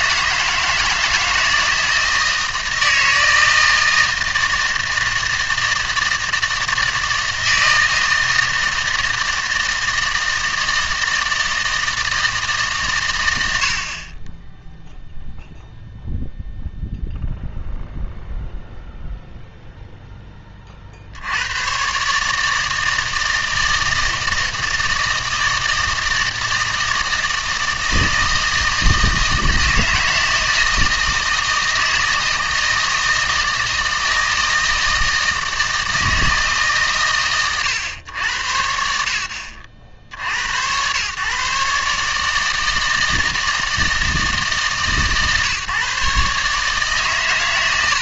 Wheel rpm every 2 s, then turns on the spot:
160, 160, 160, 160, 160, 160, 140, 10, 0, 0, 40, 160, 160, 160, 160, 160, 160, 160, 130, 50, 120, 160, 140, 140.
none